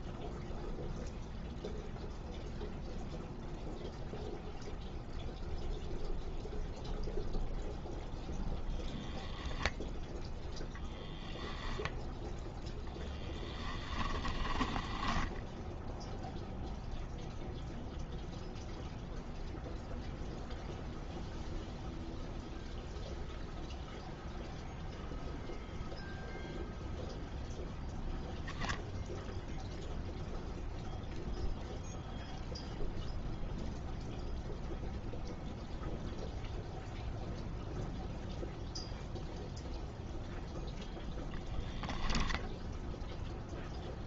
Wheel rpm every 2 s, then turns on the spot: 0, 0, 0, 0, 20, 0, 10, 10, 0, 0, 0, 0, 0, 0, 0, 0, 0, 0, 0, 0, 0, 0.
14-16